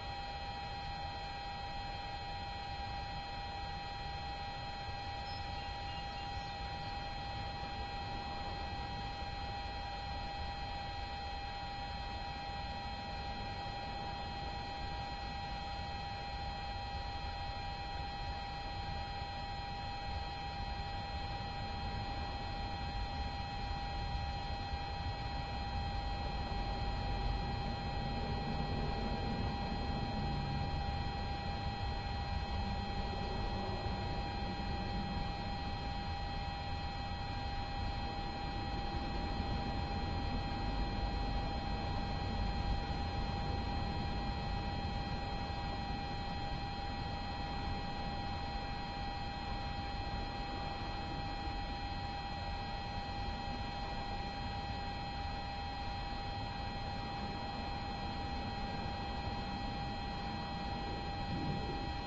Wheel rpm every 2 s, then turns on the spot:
0, 0, 0, 0, 0, 0, 0, 0, 0, 0, 0, 0, 0, 0, 0, 0, 0, 0, 0, 0, 0, 0, 0, 0, 0, 0, 0, 0, 0, 0, 0.
none